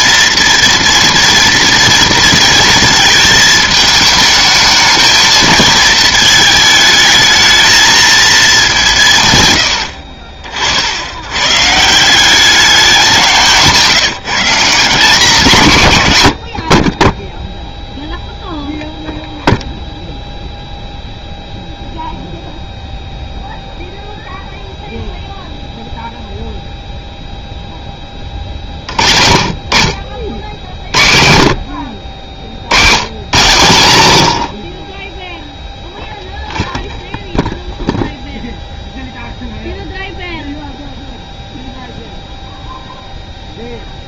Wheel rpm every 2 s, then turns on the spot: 230, 220, 220, 220, 190, 60, 190, 170, 40, 0, 0, 0, 0, 0, 30, 60, 80, 60, 0, 0, 0, 0.
none